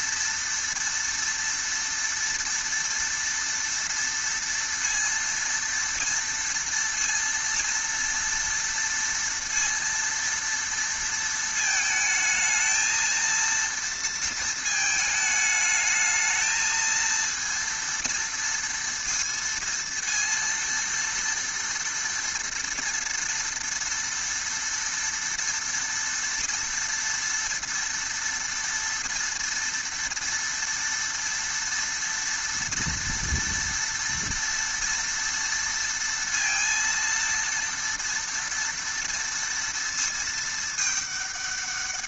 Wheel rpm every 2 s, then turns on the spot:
230, 230, 230, 230, 230, 230, 220, 230, 220, 230, 230, 230, 230, 230, 230, 230, 230, 230, 230, 230, 220.
none